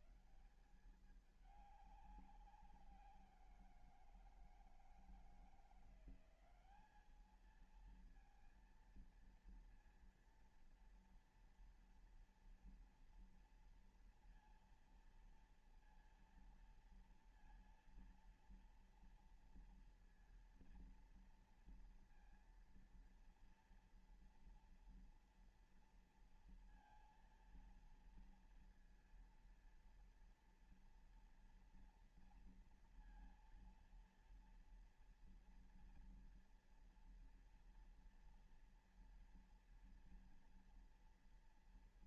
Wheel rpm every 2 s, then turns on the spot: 210, 190, 170, 190, 230, 230, 230, 230, 230, 230, 230, 230, 230, 230, 230, 230, 230, 230, 230, 230, 230.
none